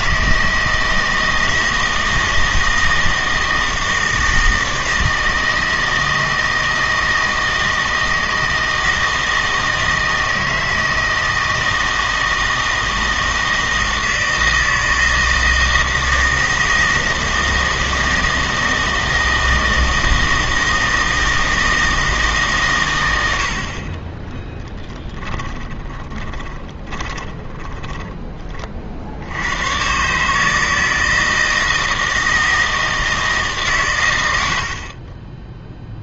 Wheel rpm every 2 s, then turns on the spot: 160, 160, 160, 160, 160, 160, 160, 160, 160, 160, 160, 120, 10, 20, 40, 160, 160, 70.
24-28